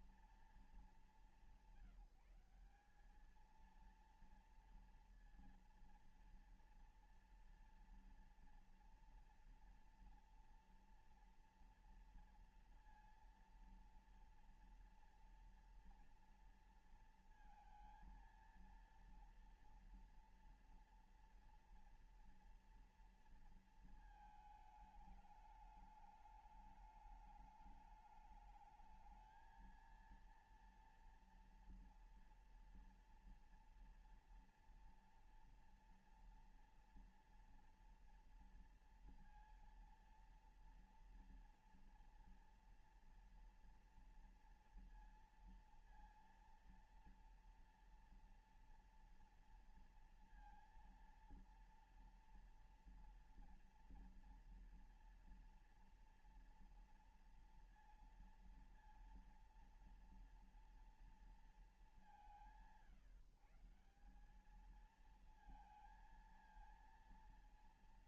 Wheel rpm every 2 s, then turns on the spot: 210, 200, 230, 230, 230, 230, 230, 230, 230, 230, 230, 230, 210, 210, 210, 230, 230, 230, 230, 230, 230, 230, 230, 230, 230, 230, 230, 230, 230, 230, 230, 170, 220, 230.
none